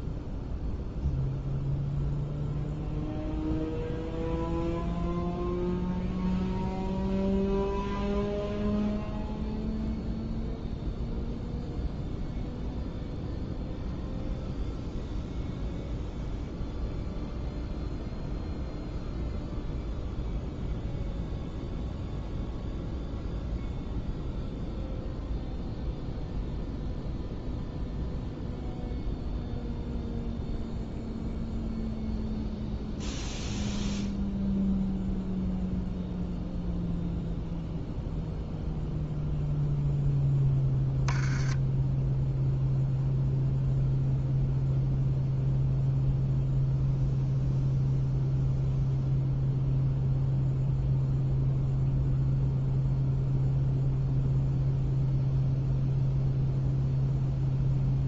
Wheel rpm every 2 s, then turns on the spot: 0, 0, 0, 0, 0, 0, 0, 0, 0, 0, 0, 0, 0, 0, 0, 0, 0, 0, 0, 0, 10, 0, 0, 0, 0, 0, 0, 0, 0.
none